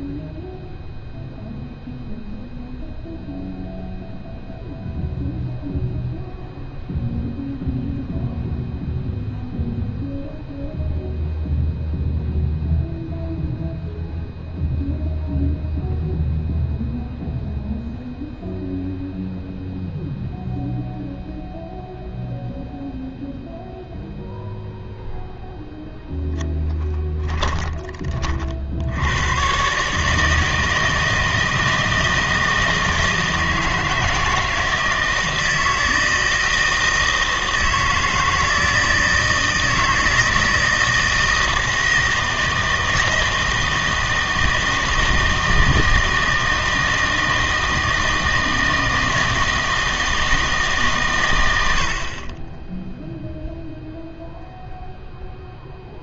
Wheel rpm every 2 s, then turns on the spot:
0, 0, 0, 0, 0, 0, 0, 0, 0, 0, 0, 0, 0, 10, 60, 160, 160, 160, 160, 160, 160, 160, 160, 160, 160, 150, 10, 0.
none